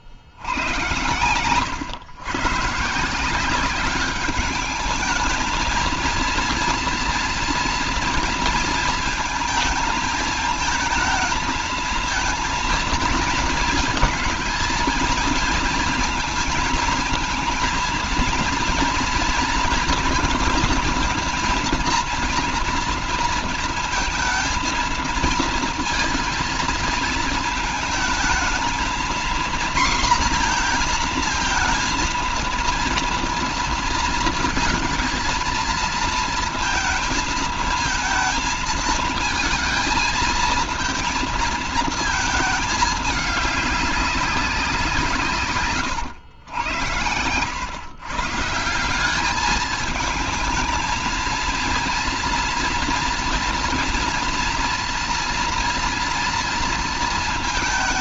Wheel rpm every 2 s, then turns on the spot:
80, 140, 200, 230, 230, 220, 230, 220, 230, 230, 230, 230, 220, 230, 220, 240, 230, 230, 230, 230, 220, 220, 180, 90, 160, 220, 230, 230, 230.
none